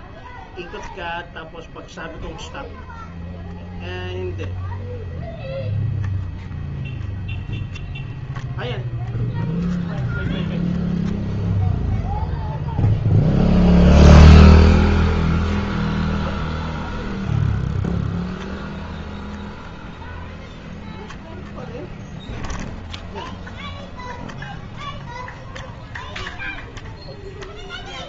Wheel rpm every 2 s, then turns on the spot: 0, 0, 0, 0, 0, 0, 0, 0, 0, 0, 20, 0, 0, 0.
20-22